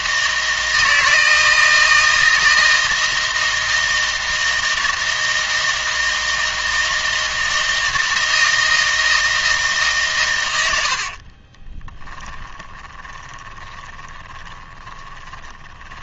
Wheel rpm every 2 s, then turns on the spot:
160, 160, 160, 160, 160, 90, 20, 30.
12-16